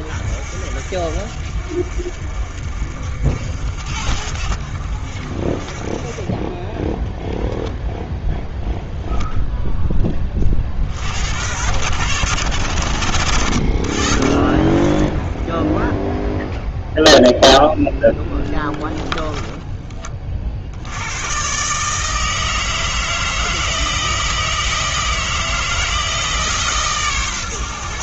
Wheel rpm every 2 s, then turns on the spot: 50, 50, 60, 10, 0, 50, 100, 20, 0, 10, 70, 160, 160, 150.
18-20